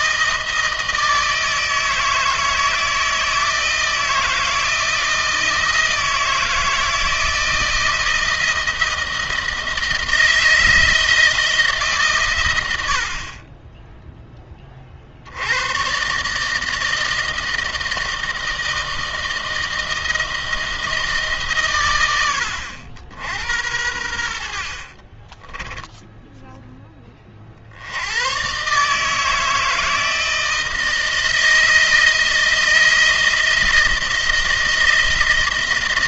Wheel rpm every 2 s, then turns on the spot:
160, 160, 160, 160, 160, 160, 100, 20, 150, 160, 160, 90, 70, 10, 130, 160, 160, 170.
none